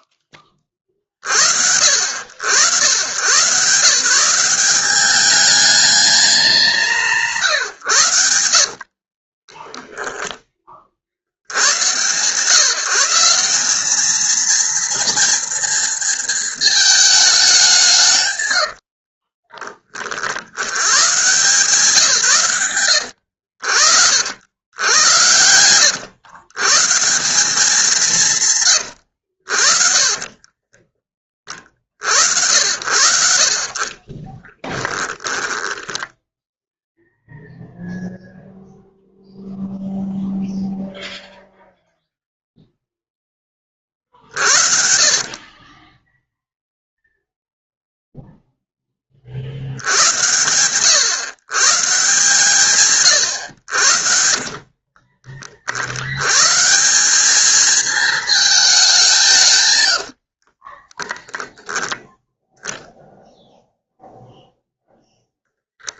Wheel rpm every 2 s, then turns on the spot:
30, 140, 210, 140, 40, 70, 170, 230, 210, 30, 120, 80, 100, 180, 70, 20, 60, 10, 0, 0, 0, 0, 60, 0, 10, 100, 150, 50, 150, 210, 40, 10, 0.
8-10 18-20 30-32 34-36 44-46 54-56 60-62